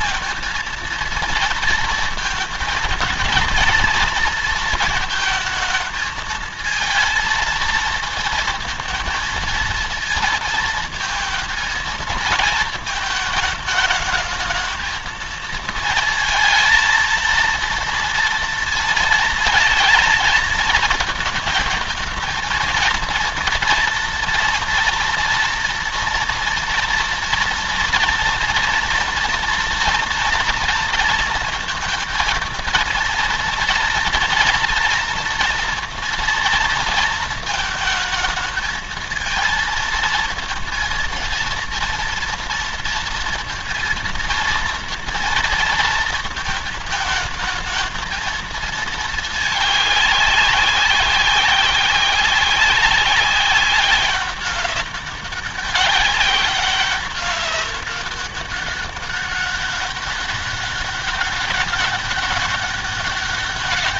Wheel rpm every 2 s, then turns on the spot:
230, 230, 230, 230, 230, 230, 220, 220, 230, 230, 220, 230, 230, 230, 240, 230, 220, 230, 230, 220, 230, 230, 230, 220, 220, 200, 190, 190, 200, 200, 200, 200.
none